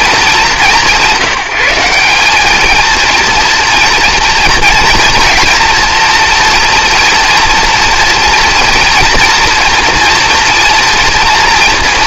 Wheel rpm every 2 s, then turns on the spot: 210, 240, 240, 240, 240, 230.
none